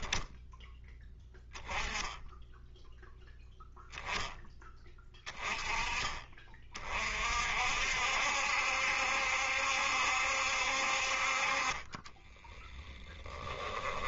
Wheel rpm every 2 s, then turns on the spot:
10, 10, 10, 30, 70, 60, 10.
12-14